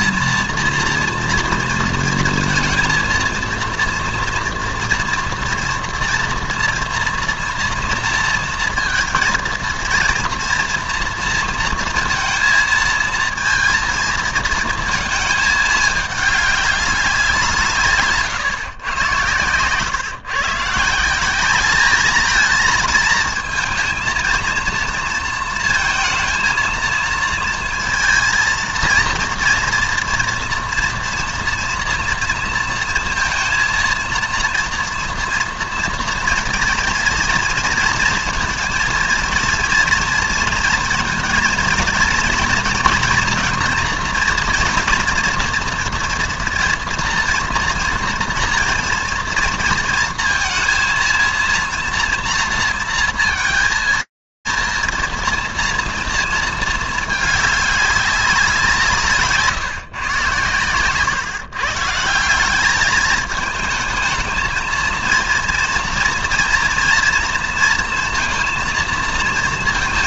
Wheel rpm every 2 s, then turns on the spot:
240, 230, 240, 230, 230, 230, 230, 220, 200, 130, 150, 230, 230, 230, 220, 240, 230, 230, 230, 230, 230, 230, 230, 230, 230, 230, 230, 230, 210, 150, 130, 210, 230, 230, 230.
none